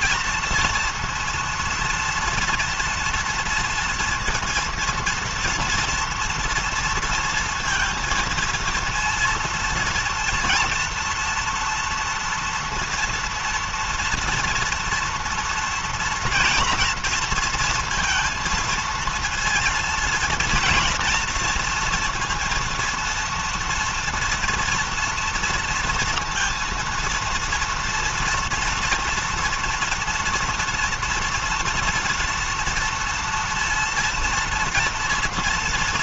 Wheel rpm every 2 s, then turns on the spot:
230, 230, 230, 230, 230, 230, 230, 230, 230, 230, 230, 230, 230, 230, 230, 230, 230, 240.
none